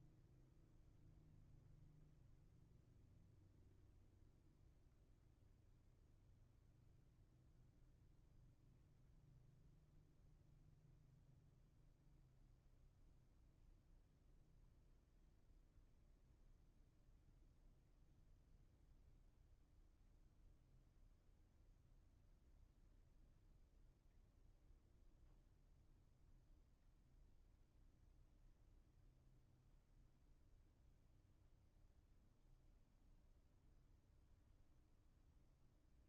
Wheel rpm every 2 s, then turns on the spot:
0, 0, 0, 0, 0, 0, 0, 0, 0, 0, 0, 0, 0, 0, 0, 0, 0, 0.
none